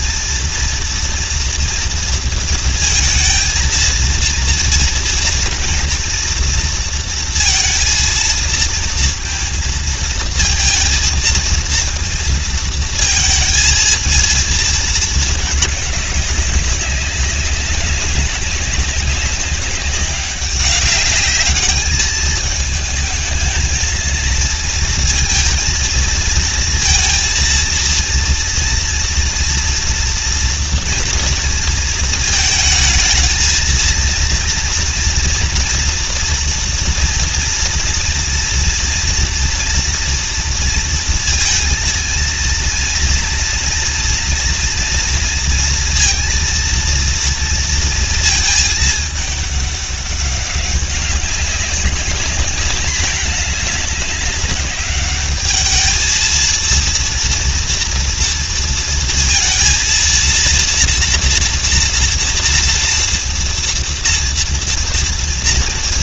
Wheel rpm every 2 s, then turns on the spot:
230, 230, 230, 230, 230, 220, 230, 220, 200, 200, 200, 220, 230, 230, 230, 230, 220, 230, 230, 230, 230, 230, 230, 230, 220, 200, 200, 200, 230, 230, 240, 230, 230.
none